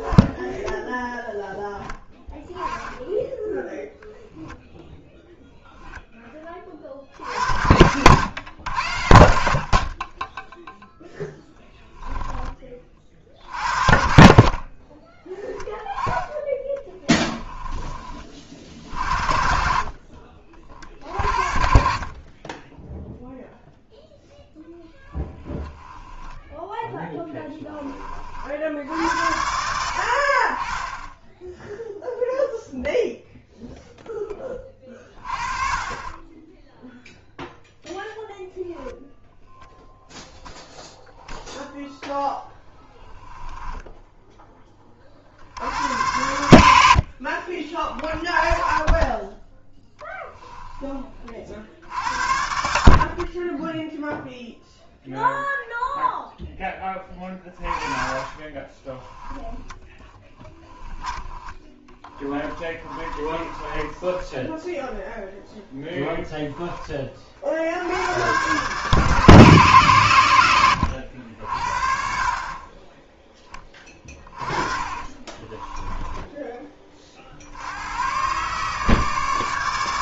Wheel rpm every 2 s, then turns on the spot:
0, 10, 0, 30, 100, 10, 30, 30, 10, 40, 50, 20, 10, 10, 60, 20, 0, 20, 10, 0, 0, 10, 20, 70, 20, 10, 60, 0, 10, 20, 10, 20, 0, 20, 120, 90, 30, 20, 20, 140.
10-12 14-18 26-28 58-64 74-76